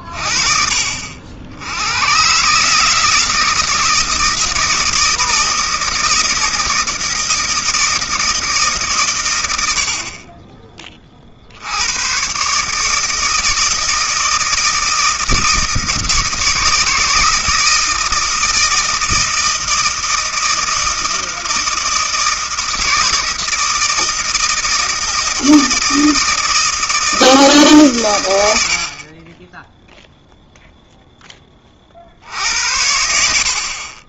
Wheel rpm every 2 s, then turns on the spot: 60, 160, 160, 160, 130, 30, 150, 160, 160, 160, 160, 160, 160, 160, 50, 0, 90.
none